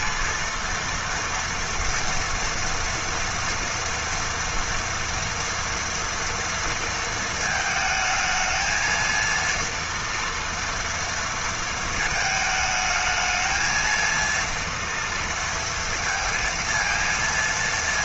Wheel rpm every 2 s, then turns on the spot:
230, 230, 230, 230, 220, 230, 220, 230, 230.
none